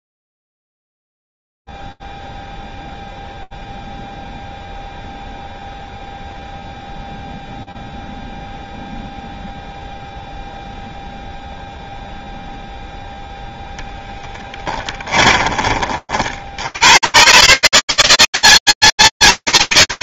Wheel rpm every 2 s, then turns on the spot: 0, 0, 0, 0, 0, 0, 0, 10, 70, 200.
14-16